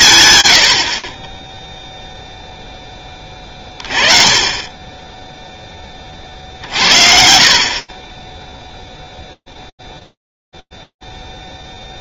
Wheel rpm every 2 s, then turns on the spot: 80, 10, 10, 60, 0, 0.
none